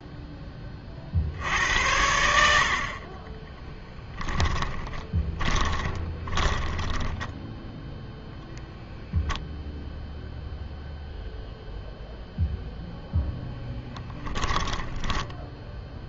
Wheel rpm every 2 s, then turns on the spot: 20, 60, 10, 20, 0, 0, 0, 10.
4-8 14-16